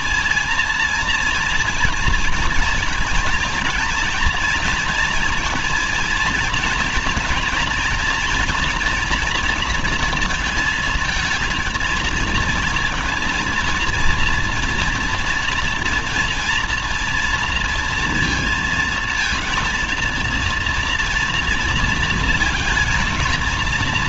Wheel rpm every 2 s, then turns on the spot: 230, 230, 240, 230, 240, 230, 230, 230, 230, 230, 230, 230.
none